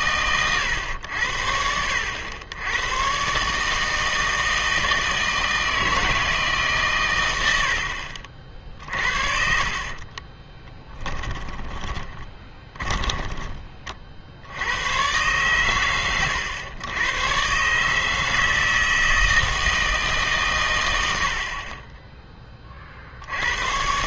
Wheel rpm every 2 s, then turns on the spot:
120, 100, 160, 150, 50, 20, 20, 90, 100, 160, 110, 30.
8-14